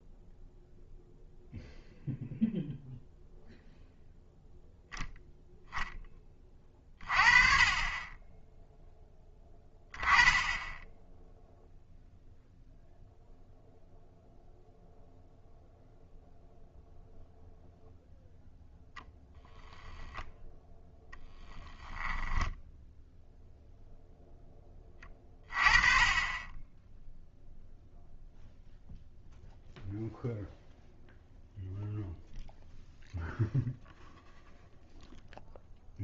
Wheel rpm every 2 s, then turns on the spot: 0, 0, 0, 30, 0, 10, 0, 0, 0, 0, 0, 10, 10, 10, 0, 0, 0, 0.
none